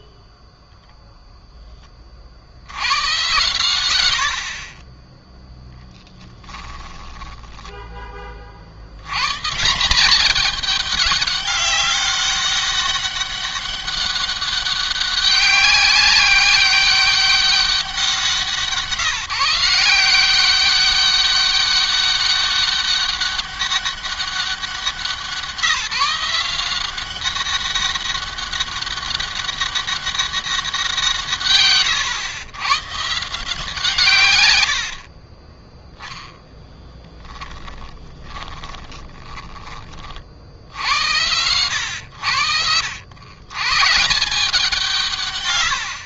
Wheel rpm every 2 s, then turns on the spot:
10, 70, 50, 10, 50, 210, 200, 200, 200, 170, 190, 200, 190, 180, 200, 190, 120, 100, 10, 30, 60, 90, 170.
0-2 4-8 34-40